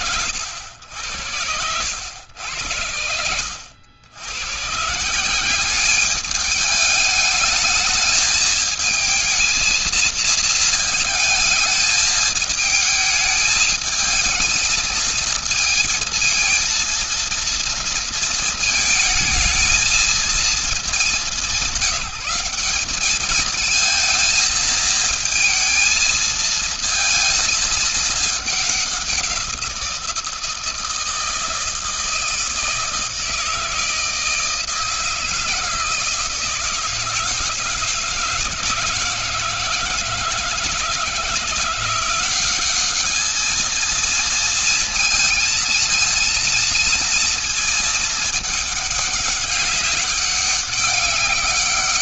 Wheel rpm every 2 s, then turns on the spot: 110, 90, 110, 210, 220, 220, 220, 220, 230, 220, 210, 190, 220, 230, 210, 170, 160, 160, 160, 160, 160, 190, 230, 230, 210, 200.
none